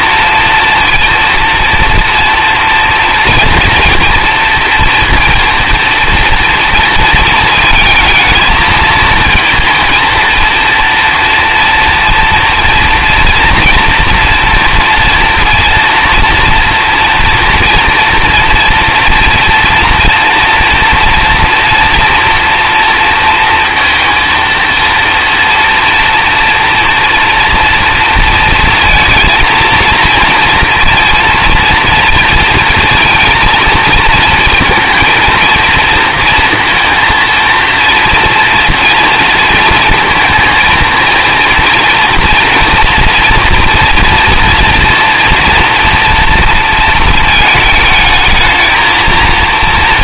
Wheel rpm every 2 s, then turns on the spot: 230, 230, 230, 230, 220, 230, 230, 230, 240, 240, 230, 230, 230, 230, 230, 230, 230, 230, 230, 230, 230, 230, 230, 230, 220.
none